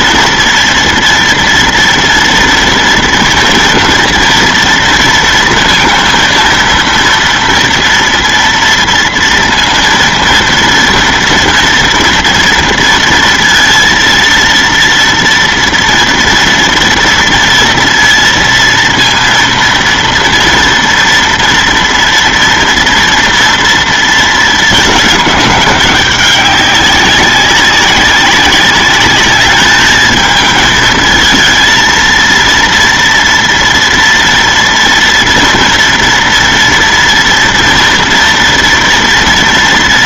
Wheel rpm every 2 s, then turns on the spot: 240, 230, 230, 230, 230, 230, 230, 230, 230, 230, 230, 230, 220, 200, 200, 220, 230, 230, 230, 230.
none